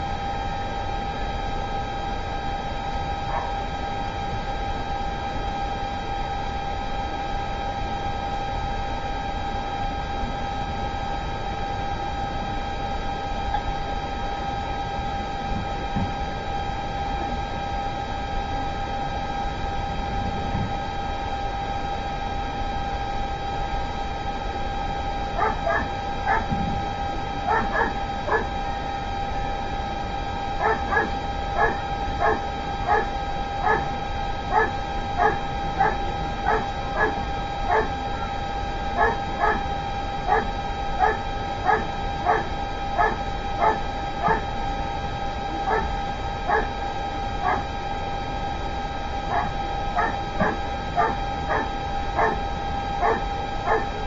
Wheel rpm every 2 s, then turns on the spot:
0, 0, 0, 0, 0, 0, 0, 0, 0, 0, 0, 0, 0, 0, 0, 0, 0, 0, 0, 0, 0, 0, 0, 0, 0, 0, 0.
none